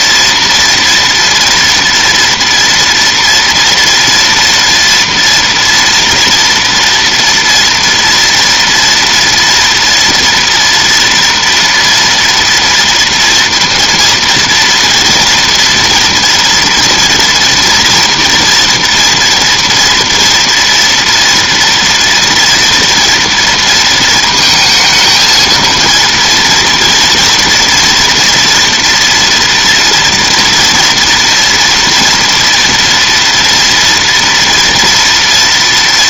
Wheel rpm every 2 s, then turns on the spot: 230, 230, 240, 230, 230, 230, 230, 230, 230, 230, 230, 230, 230, 230, 230, 230, 230, 230.
none